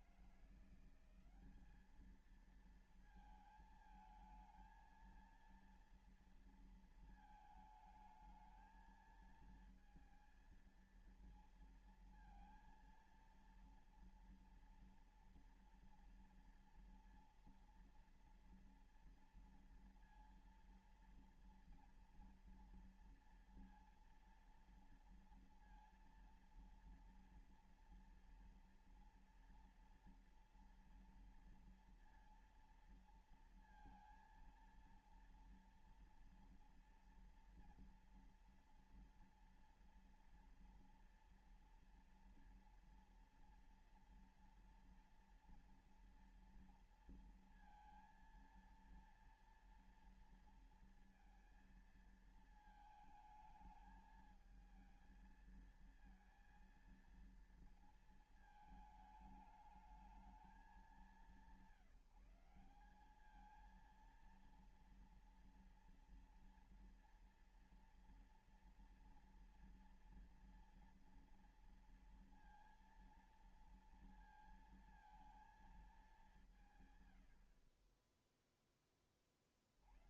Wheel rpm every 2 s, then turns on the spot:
170, 220, 220, 230, 220, 220, 230, 240, 240, 230, 230, 230, 230, 230, 240, 230, 230, 230, 240, 230, 230, 230, 230, 230, 230, 230, 220, 220, 230, 220, 220, 180, 230, 230, 230, 240, 230, 230, 180, 10.
none